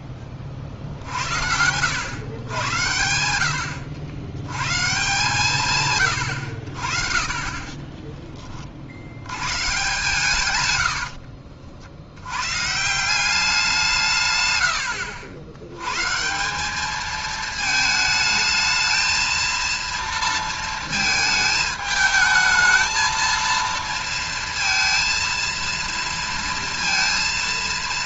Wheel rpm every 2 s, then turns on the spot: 40, 110, 120, 80, 40, 110, 130, 110, 180, 220, 230, 220, 230, 230.
10-12